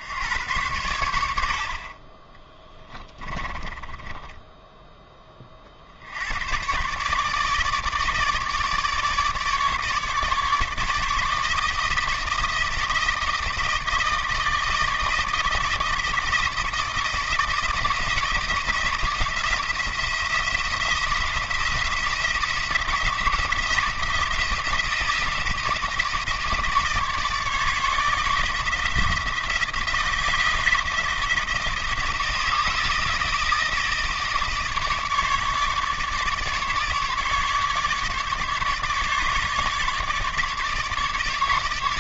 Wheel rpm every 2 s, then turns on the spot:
100, 20, 10, 120, 150, 150, 160, 160, 160, 160, 160, 170, 160, 150, 160, 160, 160, 150, 150, 150, 150.
2-4